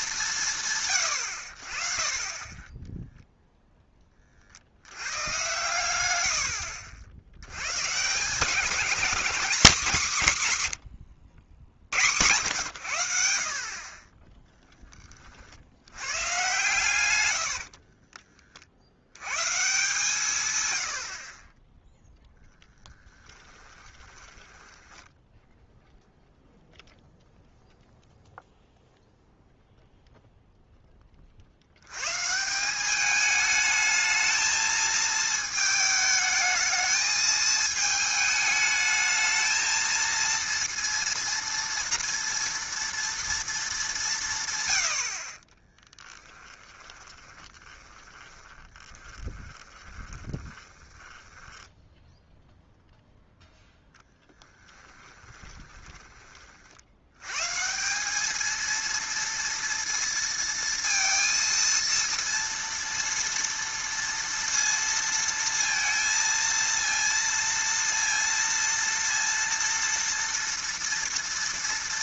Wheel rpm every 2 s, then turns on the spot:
150, 10, 60, 70, 190, 130, 120, 10, 130, 50, 120, 0, 10, 0, 0, 0, 180, 220, 220, 220, 230, 230, 130, 10, 20, 20, 0, 10, 60, 220, 230, 230, 230, 230, 230, 230.
24-26 46-52 54-56